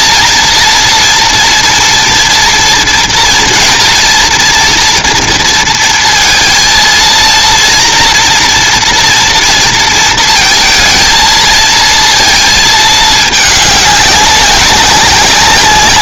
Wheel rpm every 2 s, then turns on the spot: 230, 230, 230, 230, 230, 230, 220, 190.
none